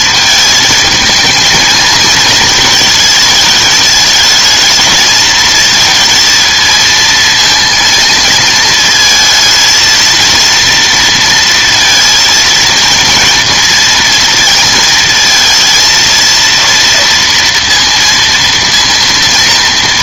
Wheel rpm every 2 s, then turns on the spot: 220, 220, 220, 230, 220, 230, 230, 230, 230, 230.
none